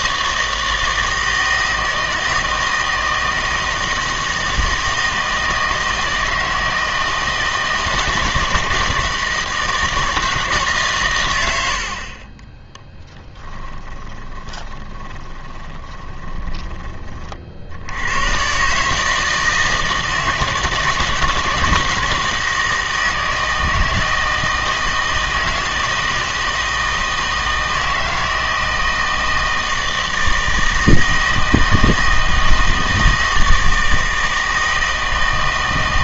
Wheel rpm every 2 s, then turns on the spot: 160, 160, 160, 160, 160, 150, 10, 20, 20, 130, 160, 160, 160, 160, 160, 160, 160, 160.
12-16